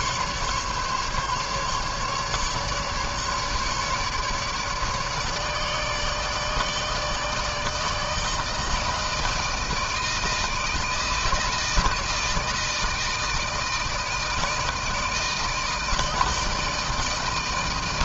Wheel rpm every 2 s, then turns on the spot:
150, 150, 150, 160, 160, 160, 160, 160, 160.
none